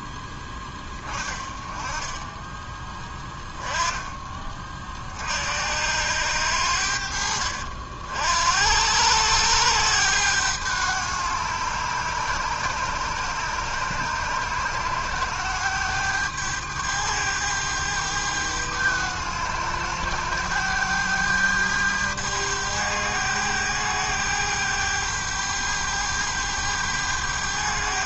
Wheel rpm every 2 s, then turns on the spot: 10, 10, 30, 80, 70, 100, 100, 100, 100, 100, 100, 100, 100, 100.
none